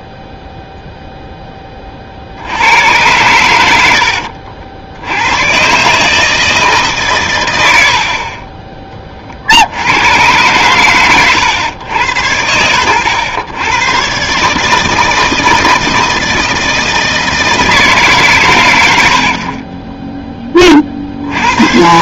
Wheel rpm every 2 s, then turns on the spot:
0, 90, 70, 150, 30, 120, 100, 150, 160, 100, 40.
none